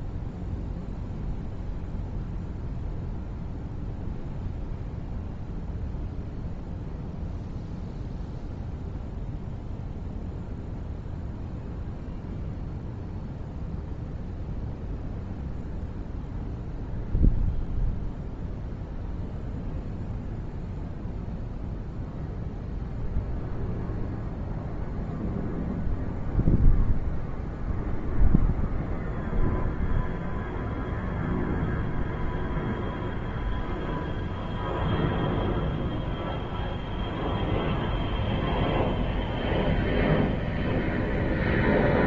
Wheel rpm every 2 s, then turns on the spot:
0, 0, 0, 0, 0, 0, 0, 0, 0, 0, 0, 0, 0, 0, 0, 0, 0, 0, 0, 0, 0.
none